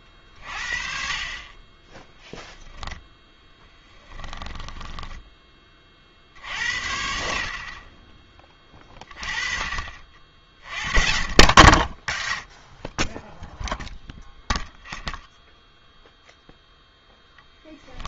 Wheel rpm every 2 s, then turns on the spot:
40, 20, 10, 60, 30, 40, 20, 0, 0.
2-6